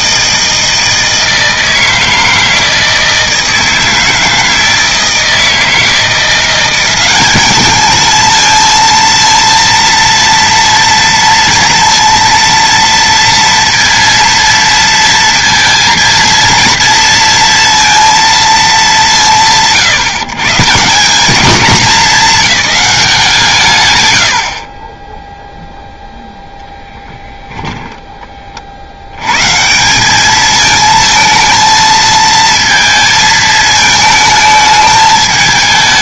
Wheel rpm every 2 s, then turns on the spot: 160, 160, 160, 190, 230, 230, 230, 230, 230, 220, 150, 190, 30, 0, 50, 220, 230, 220.
none